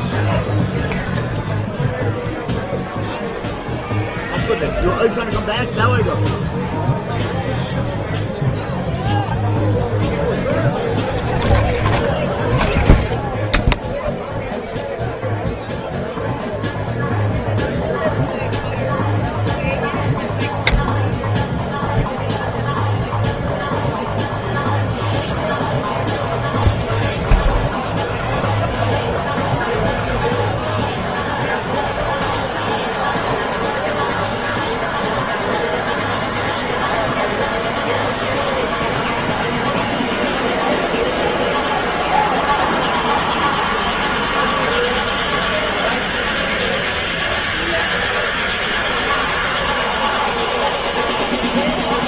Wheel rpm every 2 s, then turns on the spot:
0, 0, 0, 0, 0, 0, 0, 0, 0, 0, 0, 0, 0, 0, 0, 0, 0, 0, 0, 0, 0, 0, 0, 0, 0, 0.
none